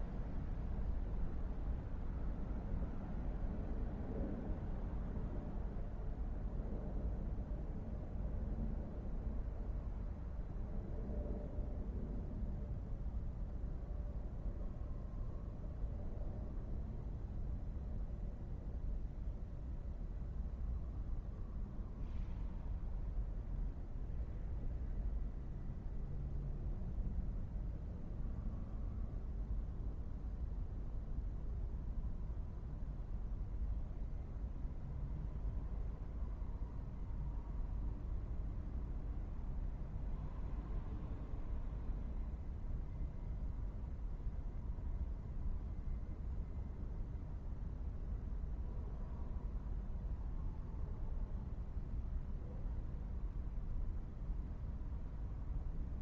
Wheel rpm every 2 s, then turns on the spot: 0, 0, 0, 0, 0, 0, 0, 0, 0, 0, 0, 0, 0, 0, 0, 0, 0, 0, 0, 0, 0, 0, 0, 0, 0, 0, 0, 0.
none